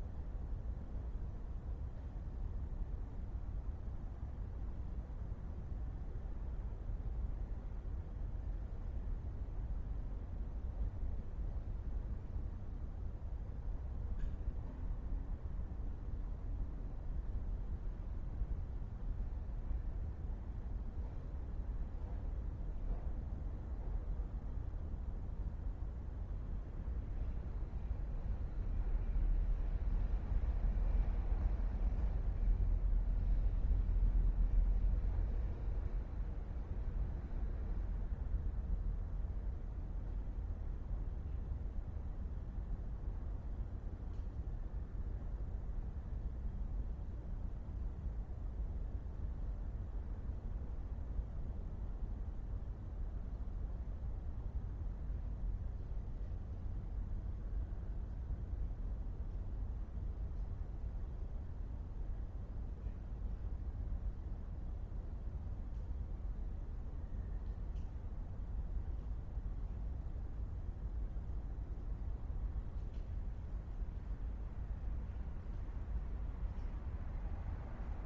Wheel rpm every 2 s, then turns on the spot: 0, 0, 0, 0, 0, 0, 0, 0, 0, 0, 0, 0, 0, 0, 0, 0, 0, 0, 0, 0, 0, 0, 0, 0, 0, 0, 0, 0, 0, 0, 0, 0, 0, 0, 0, 0, 0, 0, 0.
none